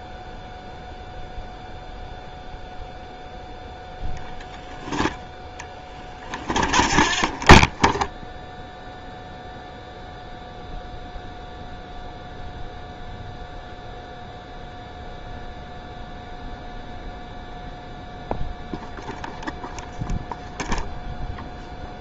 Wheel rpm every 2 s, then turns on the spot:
0, 0, 0, 20, 0, 0, 0, 0, 0, 0, 0.
6-8